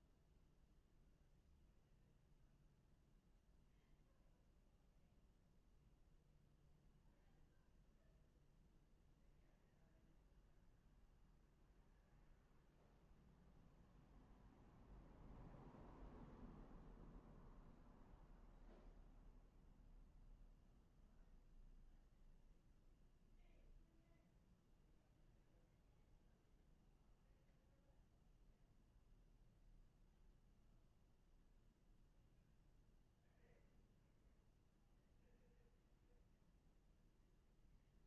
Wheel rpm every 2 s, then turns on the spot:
0, 0, 0, 0, 0, 0, 0, 0, 0, 0, 0, 0, 0, 0, 0, 0, 0, 0, 0.
none